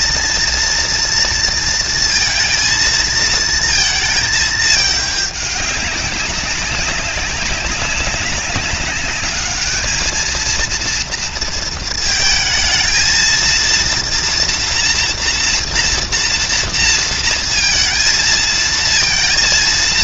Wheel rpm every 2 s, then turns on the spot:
240, 220, 210, 200, 200, 230, 230, 240, 230, 230.
none